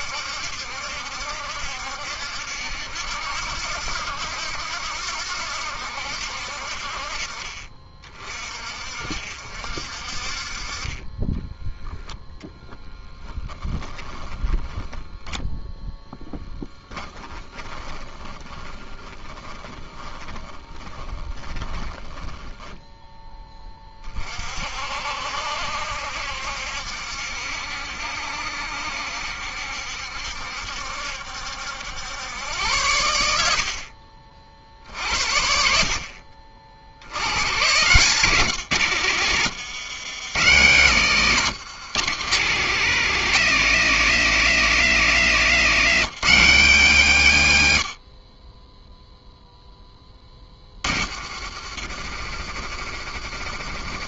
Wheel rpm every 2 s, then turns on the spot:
70, 70, 80, 60, 40, 40, 10, 20, 20, 30, 20, 10, 40, 70, 70, 70, 100, 50, 50, 130, 120, 160, 180, 180, 20, 30, 60.
14-24 38-40